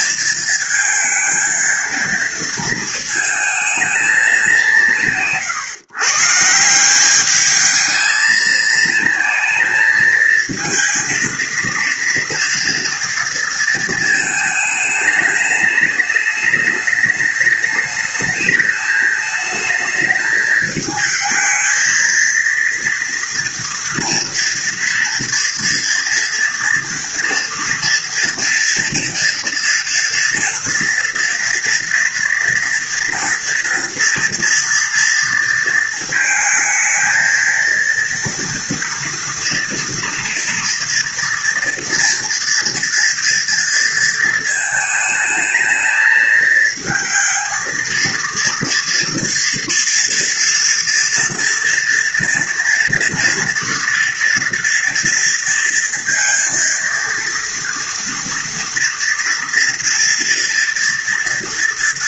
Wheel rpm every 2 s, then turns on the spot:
230, 220, 170, 180, 230, 230, 230, 210, 210, 220, 220, 230, 230, 230, 230, 230, 230, 230, 220, 230, 240, 230, 220, 220, 230, 230, 230, 230, 230, 230, 230.
none